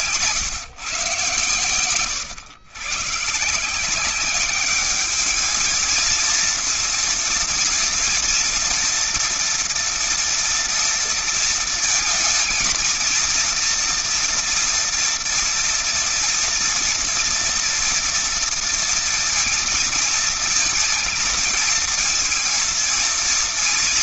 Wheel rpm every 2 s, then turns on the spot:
150, 120, 200, 230, 230, 230, 230, 230, 240, 230, 220, 230.
none